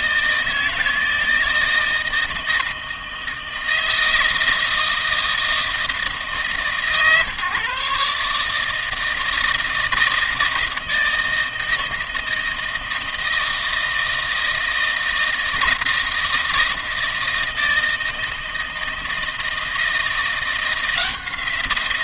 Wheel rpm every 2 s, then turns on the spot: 160, 160, 160, 140, 160, 160, 160, 160, 160, 160, 170.
none